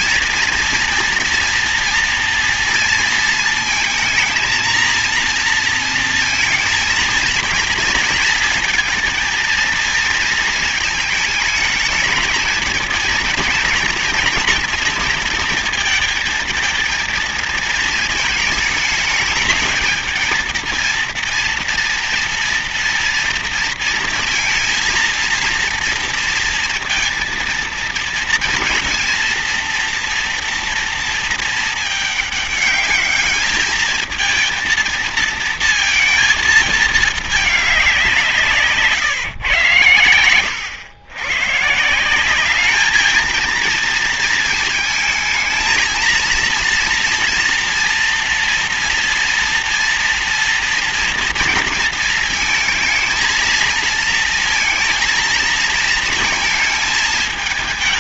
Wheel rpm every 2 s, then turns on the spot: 230, 230, 230, 230, 230, 230, 220, 220, 230, 210, 230, 230, 230, 230, 230, 230, 210, 230, 220, 150, 100, 210, 220, 230, 230, 230, 220, 230, 220.
none